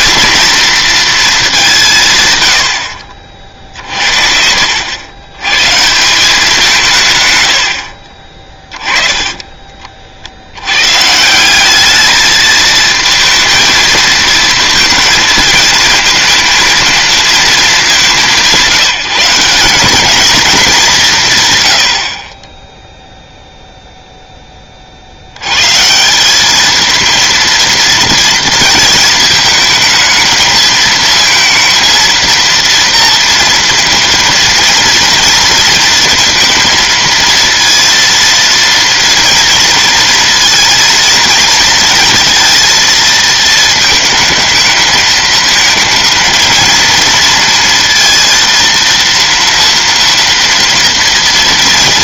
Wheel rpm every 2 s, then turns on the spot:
230, 90, 70, 190, 30, 80, 220, 220, 230, 180, 210, 20, 10, 200, 230, 220, 230, 230, 230, 230, 230, 230, 220, 220, 230, 240.
none